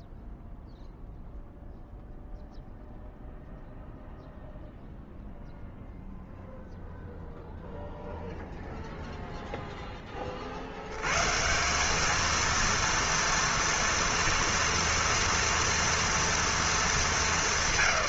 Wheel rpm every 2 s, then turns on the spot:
0, 0, 0, 0, 0, 60, 230, 240, 230.
none